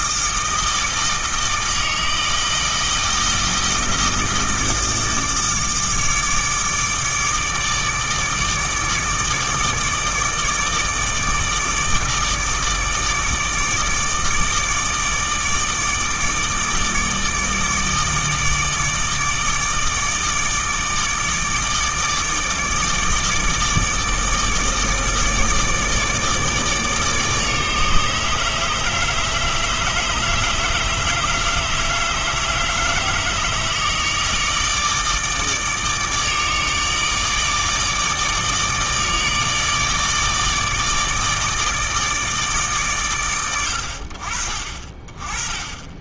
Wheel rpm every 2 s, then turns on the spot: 160, 160, 160, 150, 150, 150, 150, 150, 150, 150, 150, 150, 160, 150, 150, 150, 150, 150, 150, 150, 160, 150, 40.
none